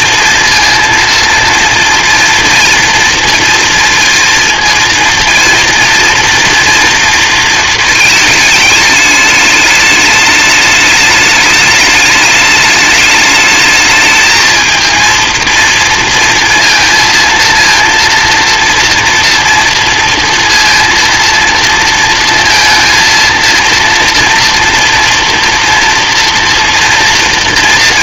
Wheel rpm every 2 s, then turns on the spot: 230, 230, 230, 230, 220, 210, 210, 220, 230, 230, 230, 230, 230, 230.
none